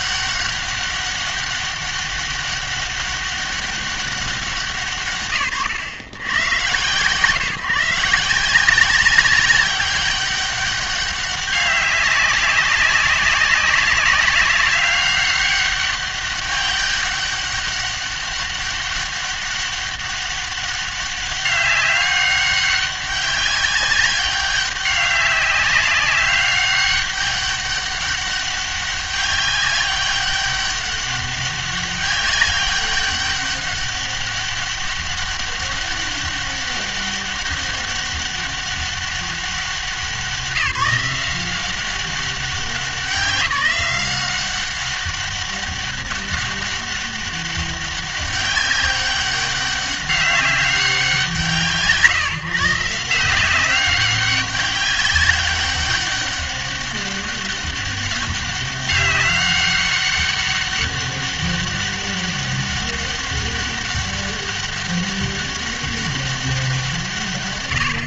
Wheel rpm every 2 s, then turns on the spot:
200, 200, 170, 120, 170, 200, 190, 190, 200, 200, 200, 200, 200, 200, 200, 200, 200, 200, 200, 200, 190, 180, 190, 200, 200, 190, 150, 200, 200, 190, 200, 200, 200, 180.
none